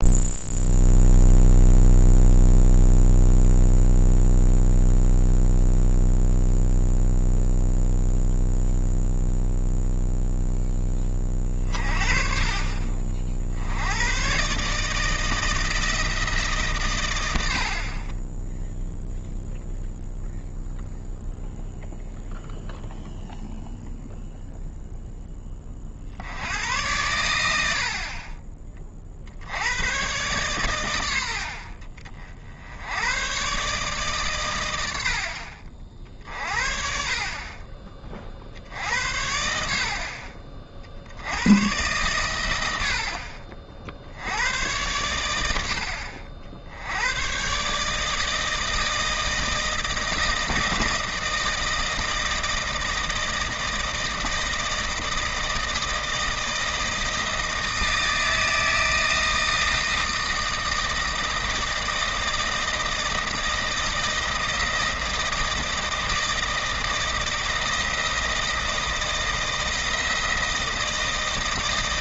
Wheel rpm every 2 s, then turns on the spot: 0, 0, 0, 0, 0, 10, 40, 150, 140, 0, 0, 0, 0, 90, 30, 120, 60, 110, 50, 60, 50, 90, 100, 70, 160, 160, 160, 160, 160, 160, 160, 160, 160, 160, 160, 160.
none